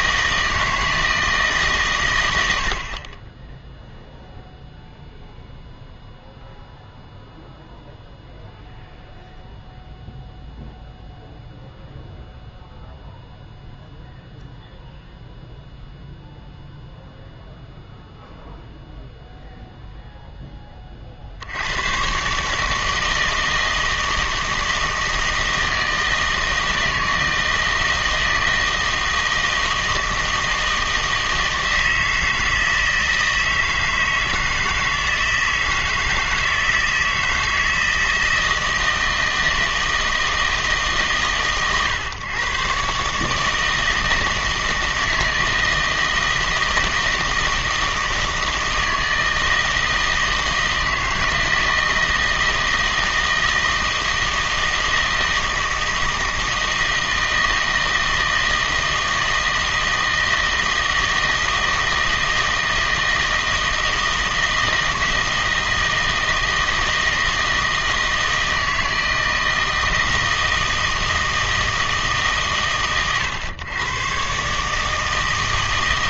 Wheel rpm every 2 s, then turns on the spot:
160, 60, 0, 0, 0, 0, 0, 0, 0, 0, 20, 160, 160, 160, 160, 160, 160, 160, 160, 160, 150, 130, 160, 160, 160, 160, 160, 160, 160, 160, 160, 160, 160, 160, 160, 160, 110, 150.
none